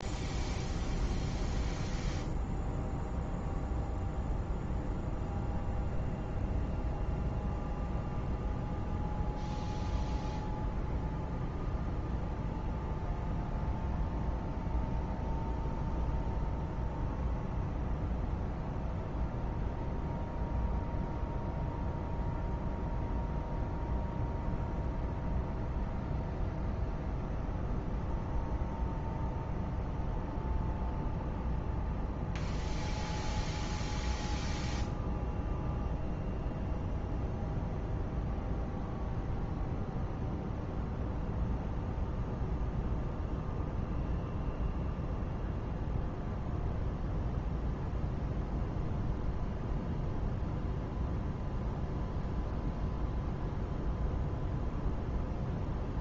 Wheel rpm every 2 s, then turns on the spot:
0, 0, 0, 0, 0, 0, 0, 0, 0, 0, 0, 0, 0, 0, 0, 0, 0, 0, 0, 0, 0, 0, 0, 0, 0, 0, 0, 0.
none